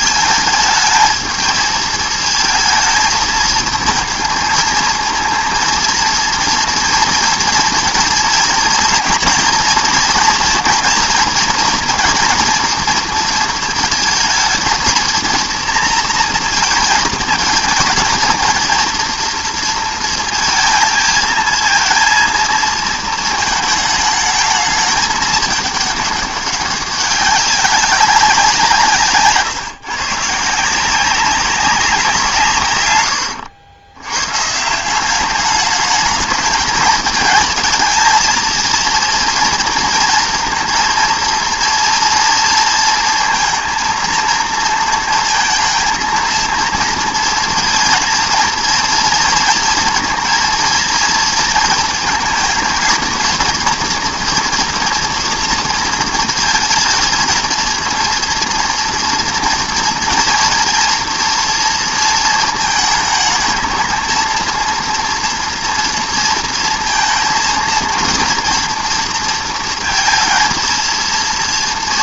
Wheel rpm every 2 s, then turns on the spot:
220, 230, 230, 230, 230, 240, 230, 220, 230, 230, 230, 230, 210, 200, 170, 170, 140, 160, 220, 230, 230, 230, 230, 230, 230, 230, 230, 230, 220, 230, 240, 220, 230, 230, 230, 230.
none